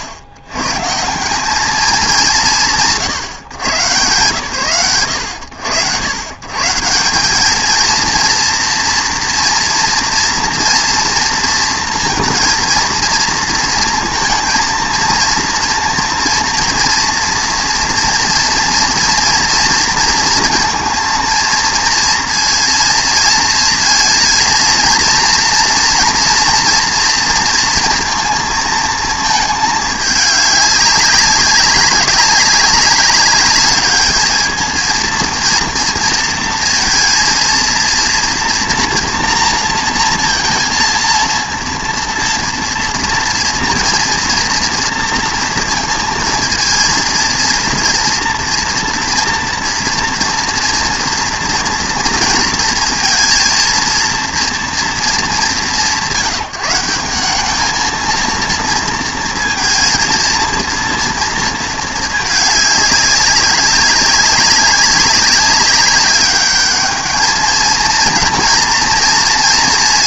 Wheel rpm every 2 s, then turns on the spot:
110, 160, 120, 120, 230, 230, 230, 230, 230, 230, 230, 230, 220, 230, 230, 200, 190, 220, 230, 240, 230, 230, 230, 230, 230, 230, 230, 230, 180, 230, 230, 210, 190, 210, 230.
none